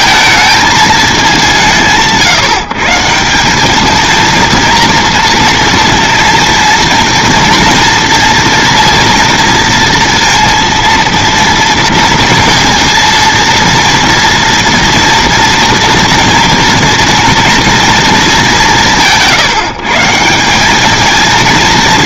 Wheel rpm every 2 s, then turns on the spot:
220, 150, 230, 230, 230, 230, 230, 230, 230, 190, 200.
none